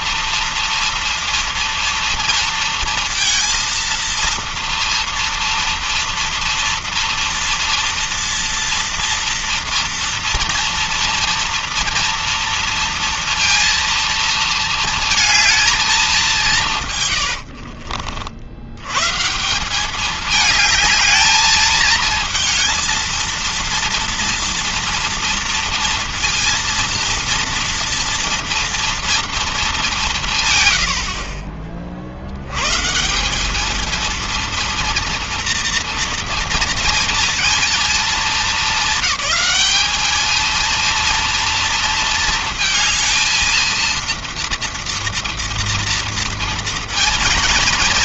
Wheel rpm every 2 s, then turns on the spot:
230, 230, 230, 230, 230, 230, 230, 230, 170, 80, 210, 220, 230, 230, 230, 130, 110, 230, 230, 220, 230, 230, 240, 230.
none